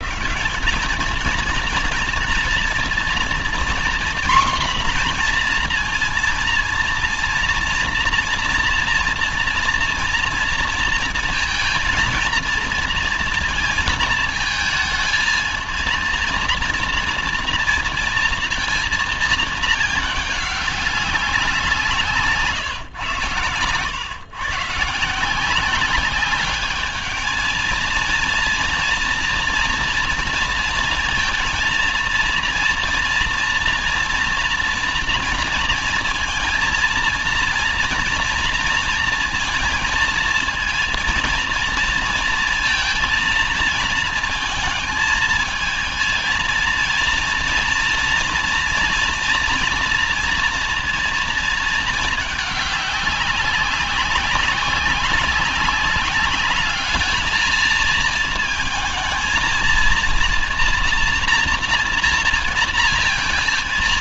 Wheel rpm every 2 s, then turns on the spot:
220, 240, 240, 230, 230, 230, 230, 230, 230, 230, 190, 120, 170, 220, 230, 230, 230, 230, 230, 230, 230, 230, 220, 230, 240, 230, 200, 190, 220, 230, 230, 230.
none